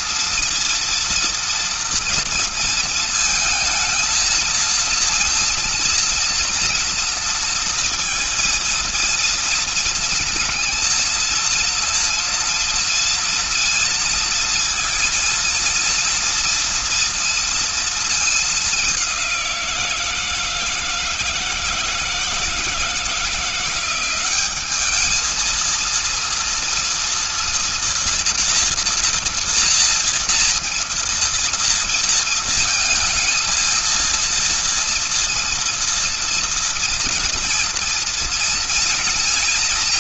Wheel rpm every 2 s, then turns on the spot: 230, 220, 230, 240, 230, 230, 230, 230, 230, 210, 170, 160, 190, 230, 230, 230, 230, 230, 230, 230.
none